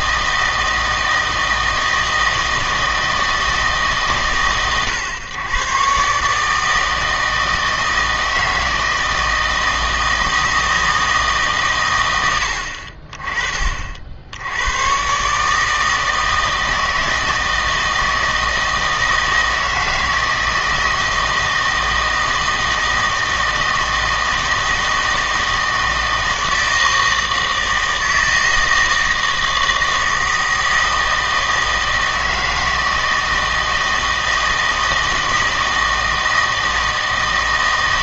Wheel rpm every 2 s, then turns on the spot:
160, 160, 110, 160, 160, 160, 60, 100, 160, 160, 160, 160, 160, 160, 160, 160, 160, 160, 160.
none